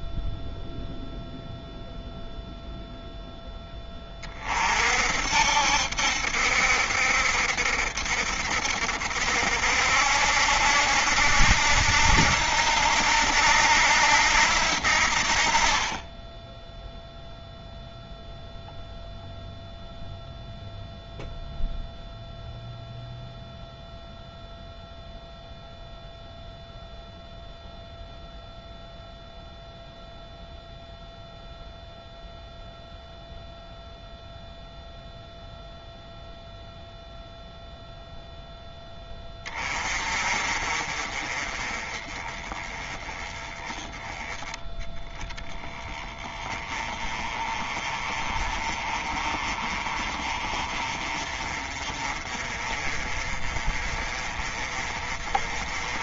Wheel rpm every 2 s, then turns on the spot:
0, 0, 50, 70, 70, 70, 80, 70, 0, 0, 0, 0, 0, 0, 0, 0, 0, 0, 0, 10, 40, 20, 10, 20, 30, 30, 30, 30.
none